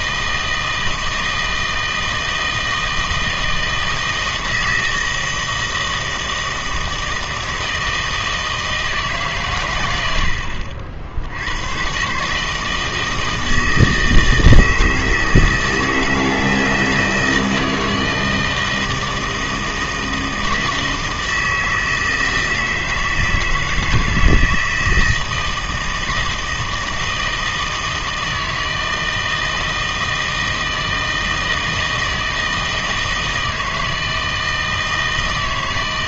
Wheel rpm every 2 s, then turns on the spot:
160, 160, 160, 160, 160, 60, 160, 160, 160, 160, 160, 160, 160, 160, 160, 160, 160, 160.
none